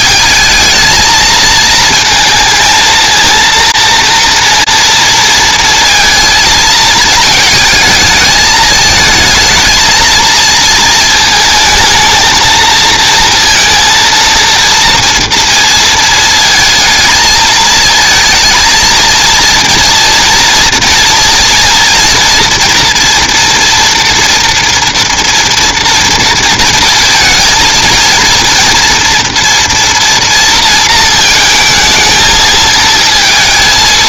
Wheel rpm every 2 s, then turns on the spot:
220, 220, 230, 220, 220, 230, 230, 230, 220, 220, 230, 240, 230, 230, 240, 230, 220.
none